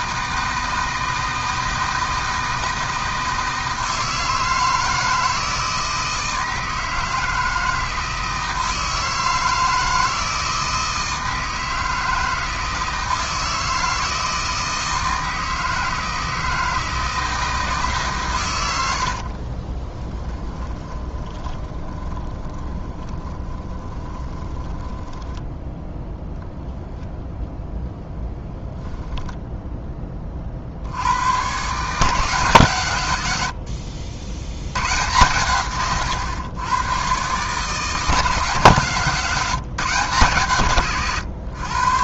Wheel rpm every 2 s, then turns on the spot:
160, 160, 160, 160, 160, 160, 160, 160, 160, 90, 20, 20, 20, 0, 0, 60, 140, 100, 120, 150, 130.
20-26